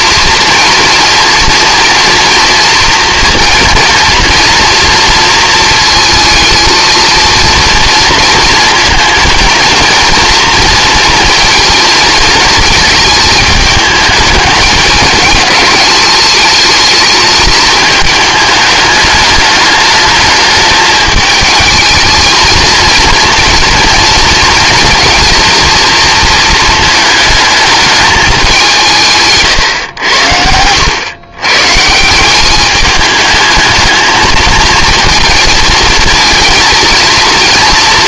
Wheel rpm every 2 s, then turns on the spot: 230, 230, 230, 230, 230, 230, 220, 210, 220, 210, 210, 230, 230, 220, 170, 100, 210, 220, 230.
none